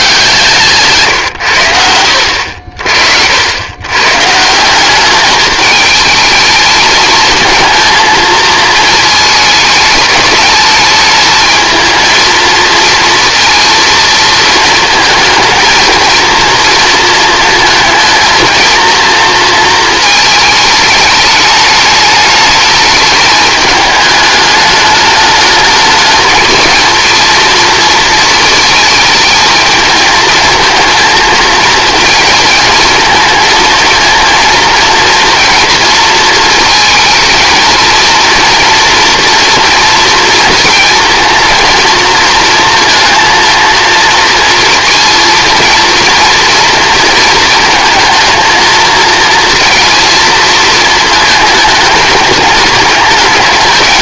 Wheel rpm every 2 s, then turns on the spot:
140, 60, 180, 220, 220, 210, 220, 220, 230, 230, 210, 210, 210, 230, 220, 220, 220, 230, 220, 230, 230, 230, 230, 230, 220, 230, 210.
none